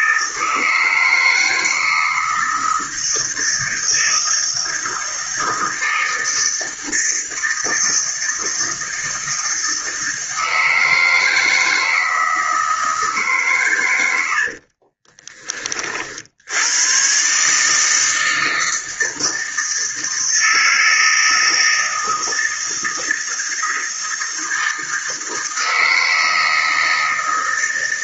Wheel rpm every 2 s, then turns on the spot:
160, 160, 160, 160, 160, 160, 160, 50, 110, 160, 160, 160, 160, 160.
14-16